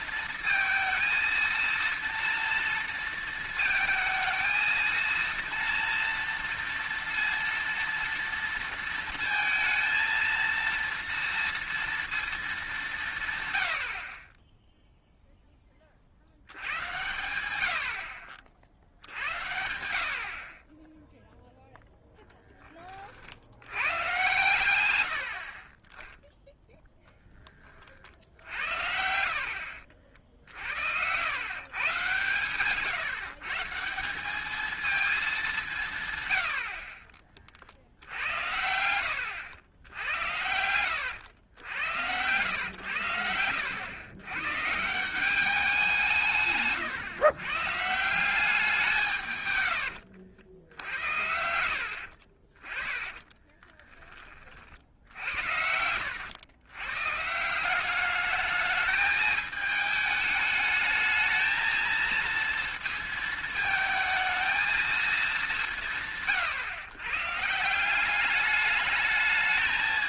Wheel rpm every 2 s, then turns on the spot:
230, 230, 220, 230, 230, 230, 210, 10, 80, 50, 30, 10, 120, 0, 70, 60, 130, 210, 90, 90, 90, 110, 140, 150, 190, 70, 30, 40, 110, 210, 210, 230, 220, 140, 210.
52-54